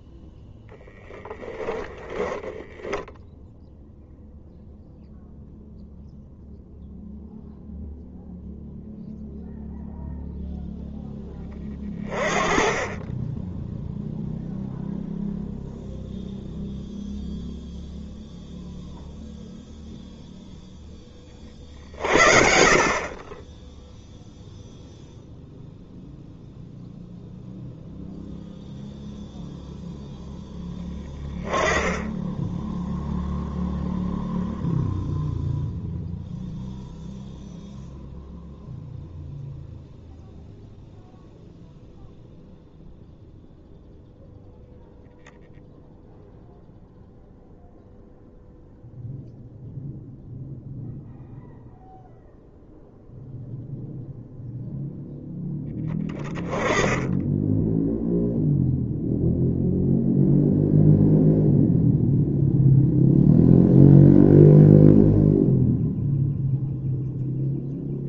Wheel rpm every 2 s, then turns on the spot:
10, 20, 0, 0, 0, 0, 20, 0, 0, 0, 0, 50, 0, 0, 0, 10, 10, 0, 0, 0, 0, 0, 0, 0, 0, 0, 0, 0, 20, 0, 0, 0, 0, 0.
2-4